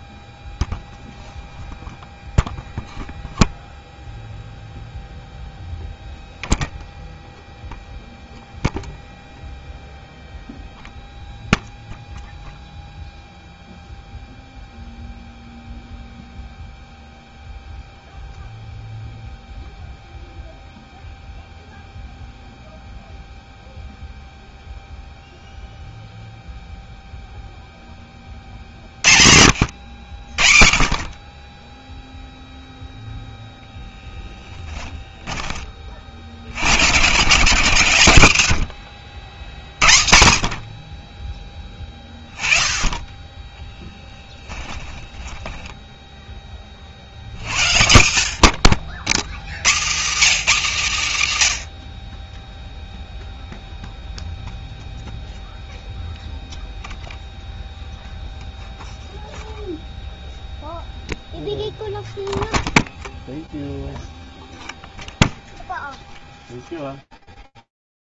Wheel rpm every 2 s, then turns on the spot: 0, 0, 0, 0, 0, 0, 0, 0, 0, 0, 0, 0, 0, 0, 30, 60, 0, 20, 80, 90, 70, 20, 10, 20, 80, 230, 20, 0, 0, 0, 0, 0, 0, 0.
34-36 44-46